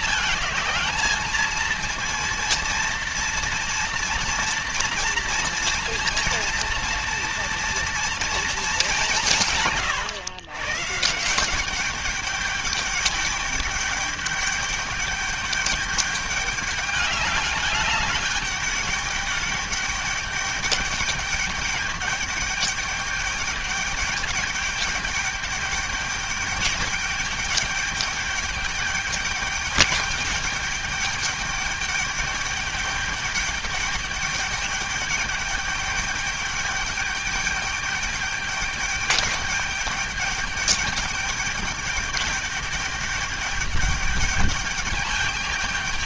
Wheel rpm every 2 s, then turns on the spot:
210, 230, 230, 230, 210, 140, 210, 210, 200, 200, 210, 210, 210, 210, 210, 210, 210, 210, 210, 210, 210, 210, 210.
none